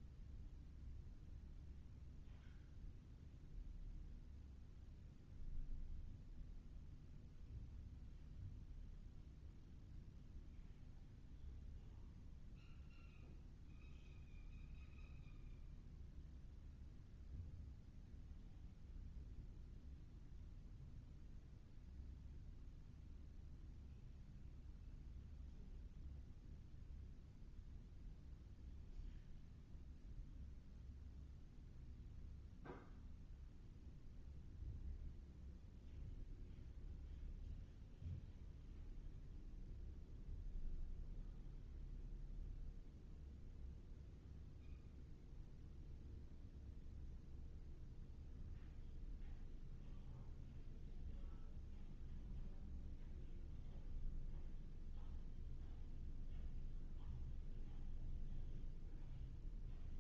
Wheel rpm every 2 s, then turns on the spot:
0, 0, 0, 0, 0, 0, 0, 0, 0, 0, 0, 0, 0, 0, 0, 0, 0, 0, 0, 0, 0, 0, 0, 0, 0, 0, 0, 0, 0, 0.
none